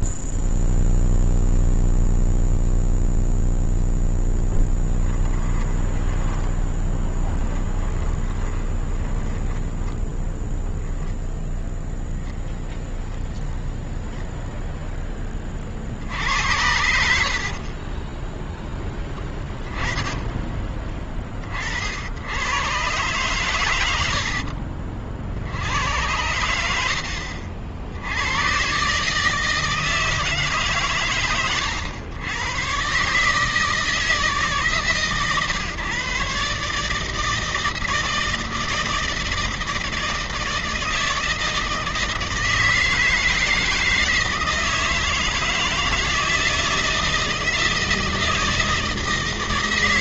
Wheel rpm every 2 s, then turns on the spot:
0, 0, 0, 20, 30, 10, 10, 0, 80, 10, 20, 120, 50, 90, 140, 130, 120, 140, 140, 160, 160, 160, 160, 160, 160.
6-10